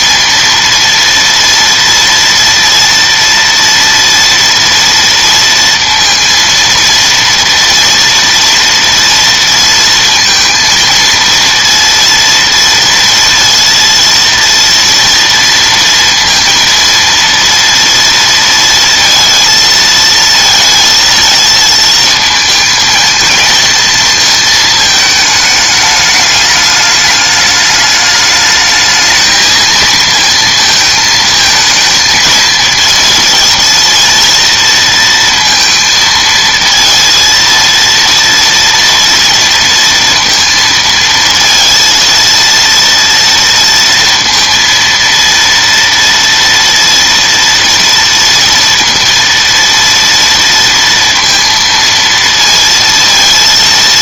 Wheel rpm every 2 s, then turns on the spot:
230, 230, 230, 230, 230, 230, 230, 230, 230, 230, 230, 220, 220, 210, 210, 230, 230, 230, 230, 230, 230, 230, 230, 230, 230, 230, 230.
none